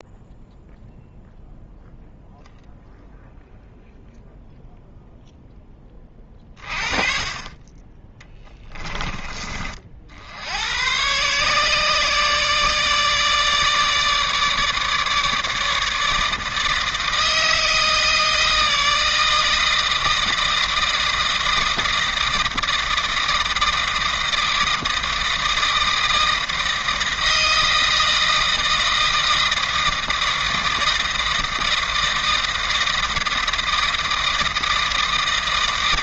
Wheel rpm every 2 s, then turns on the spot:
0, 0, 0, 20, 20, 100, 150, 150, 160, 160, 160, 160, 160, 160, 160, 160, 160, 160.
none